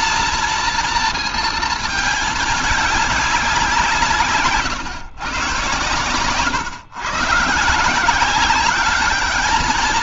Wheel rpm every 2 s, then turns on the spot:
230, 210, 140, 130, 200.
none